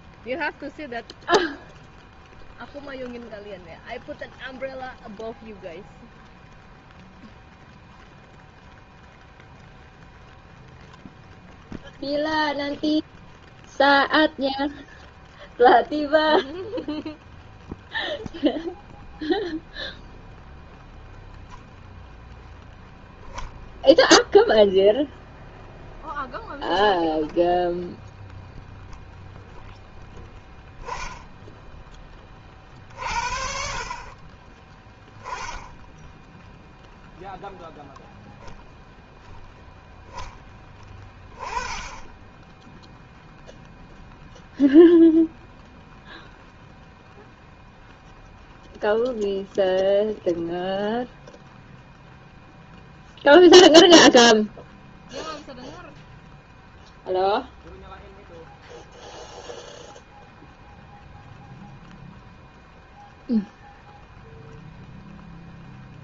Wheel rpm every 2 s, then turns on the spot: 0, 0, 0, 0, 0, 0, 0, 0, 0, 0, 0, 0, 0, 0, 10, 10, 30, 20, 0, 0, 20, 10, 0, 0, 0, 0, 0, 0, 0, 0, 0, 0, 0.
none